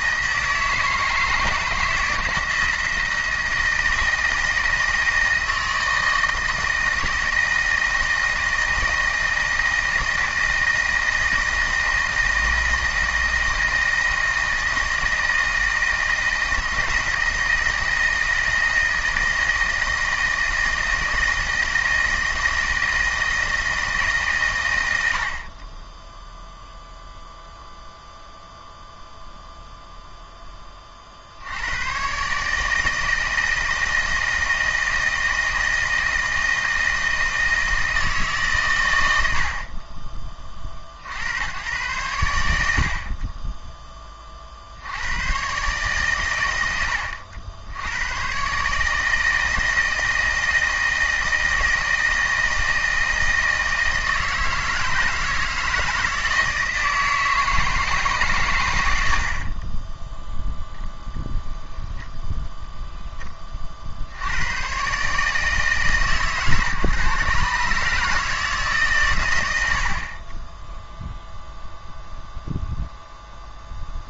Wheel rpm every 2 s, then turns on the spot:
160, 160, 160, 160, 160, 160, 160, 160, 160, 160, 160, 160, 110, 0, 0, 20, 150, 160, 160, 130, 50, 80, 60, 100, 150, 160, 160, 160, 160, 110, 0, 0, 100, 130, 150, 10, 0.
none